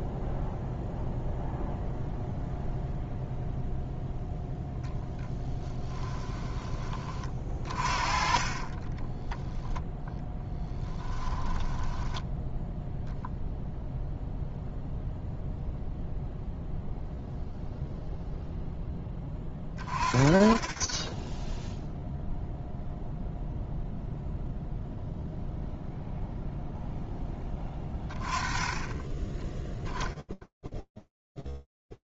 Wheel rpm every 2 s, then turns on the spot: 0, 0, 10, 20, 30, 10, 10, 0, 0, 10, 10, 0, 0, 0, 10, 10.
6-10 12-14